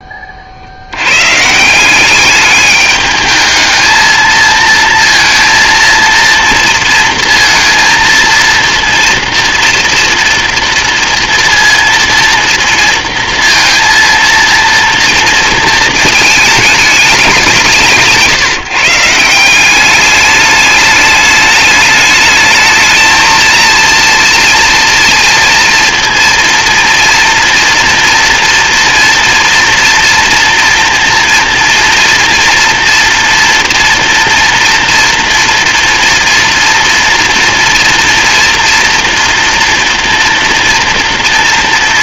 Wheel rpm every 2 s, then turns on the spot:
100, 210, 230, 230, 230, 230, 230, 230, 200, 150, 210, 220, 230, 230, 230, 230, 230, 230, 230, 240, 230.
none